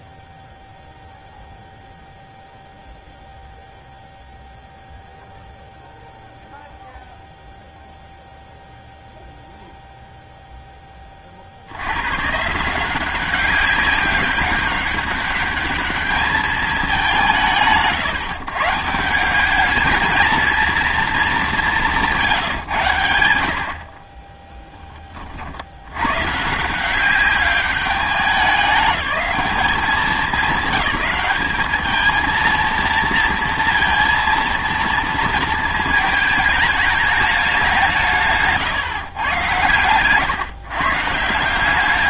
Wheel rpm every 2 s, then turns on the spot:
0, 0, 0, 0, 0, 20, 180, 200, 160, 160, 220, 80, 10, 170, 200, 200, 230, 230, 210, 140, 130.
none